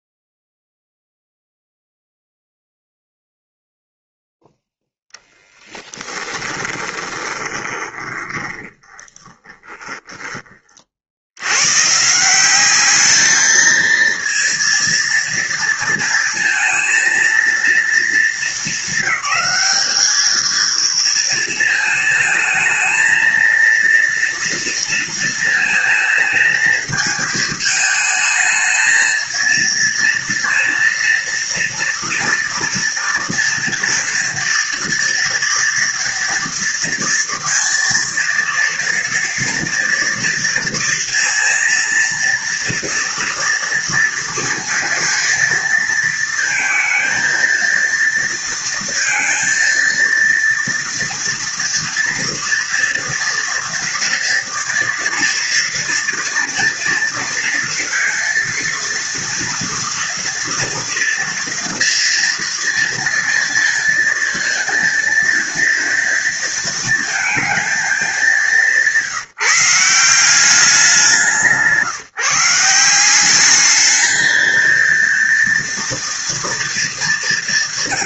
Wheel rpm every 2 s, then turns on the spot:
0, 0, 0, 20, 20, 70, 210, 230, 230, 200, 230, 230, 230, 220, 220, 230, 230, 230, 230, 230, 230, 230, 230, 220, 230, 230, 230, 230, 230, 230, 230, 230, 230, 220, 160, 180, 190, 230, 210.
6-10